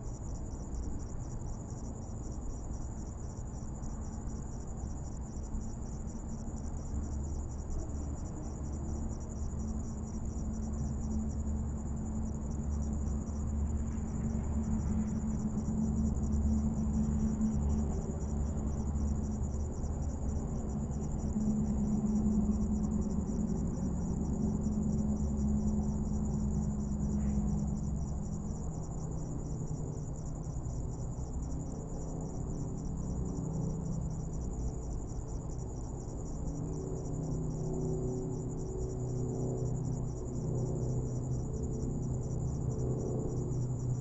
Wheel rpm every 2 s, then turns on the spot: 0, 0, 0, 0, 0, 0, 0, 0, 0, 0, 0, 0, 0, 0, 0, 0, 0, 0, 0, 0, 0, 0.
none